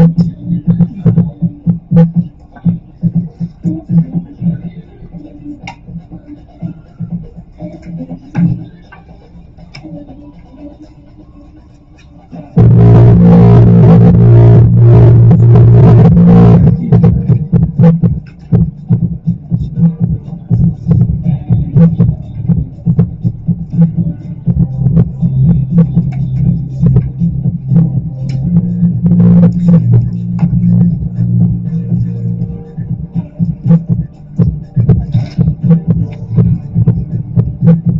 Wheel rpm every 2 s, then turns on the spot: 0, 0, 0, 0, 0, 0, 0, 0, 0, 0, 0, 0, 0, 0, 0, 0, 0, 0, 0.
none